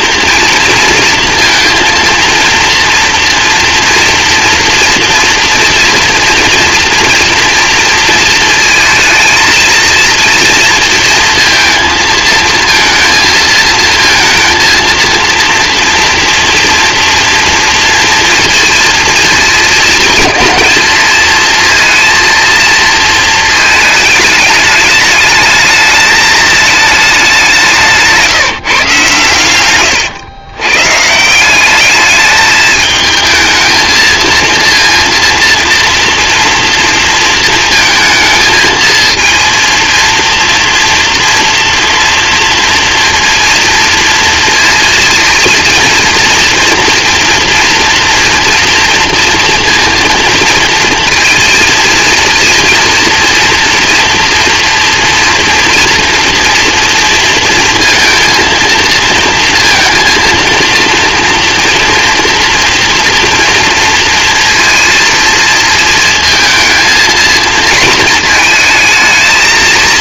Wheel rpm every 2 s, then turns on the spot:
230, 230, 230, 230, 230, 230, 230, 230, 230, 230, 220, 230, 210, 210, 160, 120, 220, 230, 230, 220, 230, 230, 230, 230, 240, 230, 230, 230, 230, 230, 230, 230, 230, 220, 220.
none